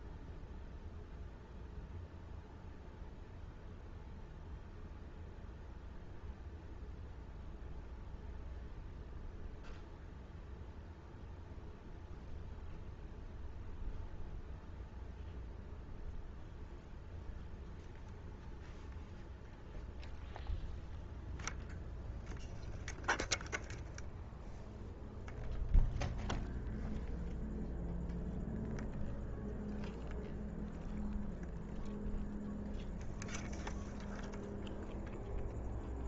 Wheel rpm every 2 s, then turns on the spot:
0, 0, 0, 0, 0, 0, 0, 0, 0, 0, 0, 0, 0, 0, 0, 0, 0, 0.
none